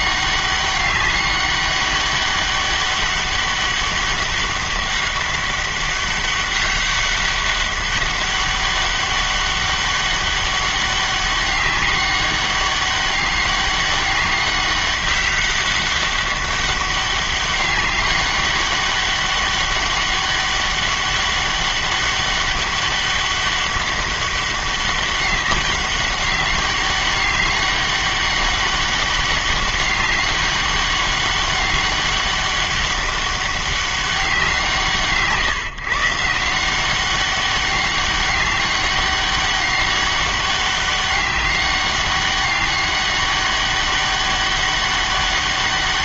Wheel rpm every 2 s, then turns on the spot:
200, 200, 200, 200, 200, 200, 200, 200, 200, 200, 200, 200, 200, 200, 200, 200, 200, 170, 180, 200, 200, 200, 200.
none